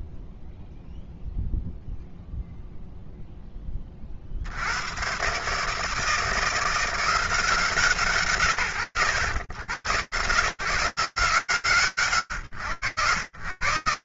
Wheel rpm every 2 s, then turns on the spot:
0, 0, 120, 180, 100, 160, 120.
none